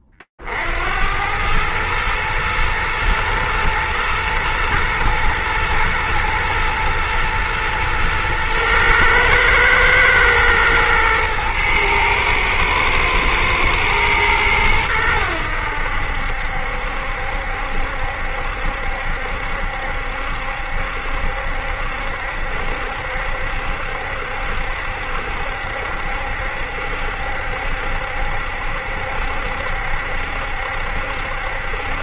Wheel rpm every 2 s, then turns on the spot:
50, 110, 120, 120, 110, 110, 110, 110, 70, 70, 70, 70, 70, 70, 70, 70.
none